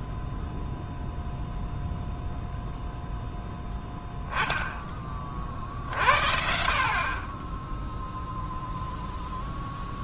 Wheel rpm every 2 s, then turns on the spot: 0, 0, 10, 60, 0.
none